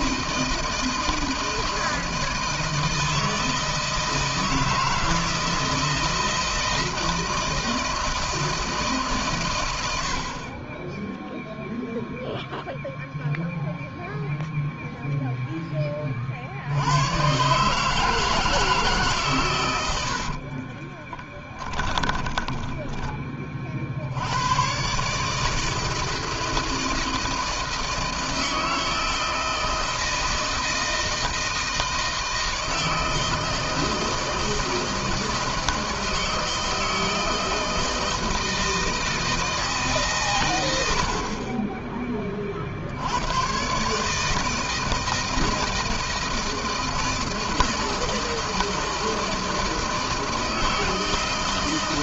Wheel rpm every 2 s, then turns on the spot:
160, 160, 160, 160, 150, 20, 0, 0, 100, 150, 30, 20, 130, 160, 160, 170, 160, 160, 160, 160, 90, 60, 160, 160, 160, 160.
20-24